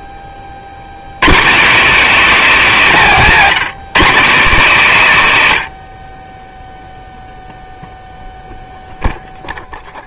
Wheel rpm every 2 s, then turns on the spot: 40, 220, 180, 10, 0.
none